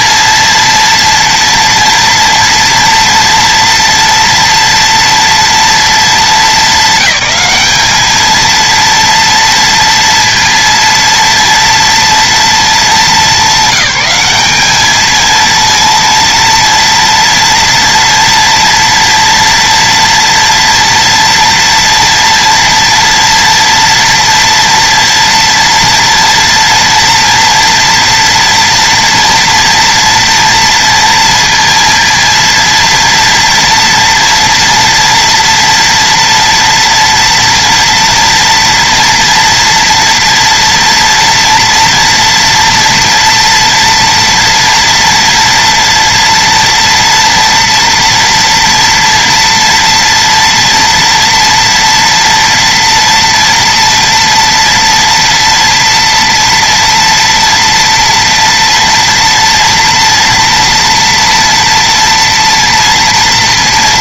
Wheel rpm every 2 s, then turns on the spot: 230, 230, 230, 220, 230, 230, 220, 210, 230, 240, 230, 230, 230, 240, 230, 230, 230, 240, 230, 230, 230, 230, 230, 230, 230, 230, 230, 230, 230, 230, 240, 230.
none